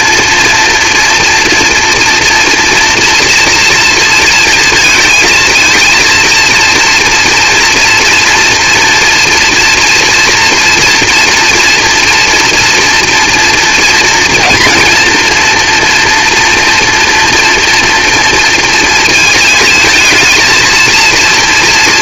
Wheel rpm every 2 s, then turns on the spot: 240, 230, 230, 240, 230, 240, 240, 240, 230, 220, 230.
none